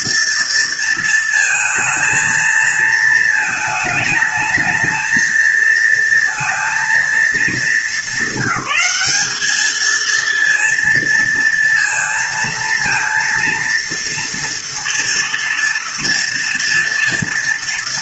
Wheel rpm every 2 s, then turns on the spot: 230, 230, 220, 230, 200, 230, 230, 230, 230.
none